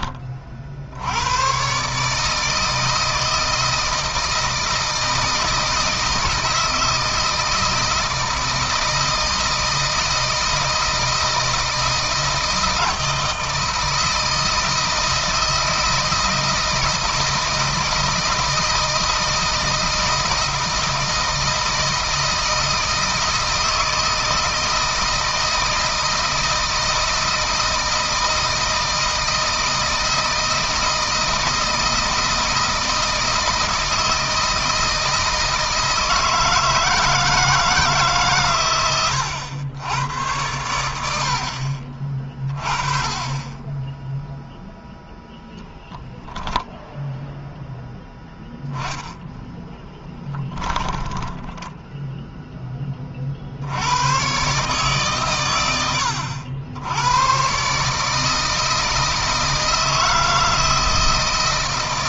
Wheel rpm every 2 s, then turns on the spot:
60, 160, 160, 160, 160, 160, 160, 160, 160, 160, 160, 160, 160, 160, 170, 160, 160, 160, 160, 120, 90, 20, 0, 0, 10, 20, 20, 120, 80, 160, 160.
50-52